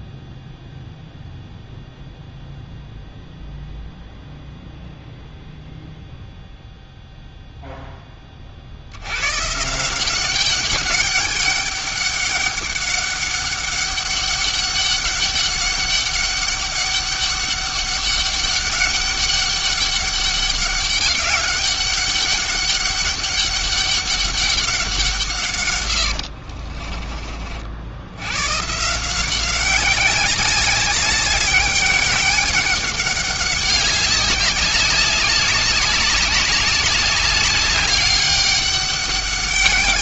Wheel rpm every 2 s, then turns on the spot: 0, 0, 0, 0, 50, 200, 200, 200, 200, 200, 200, 200, 190, 40, 140, 190, 200, 190, 200, 200.
26-28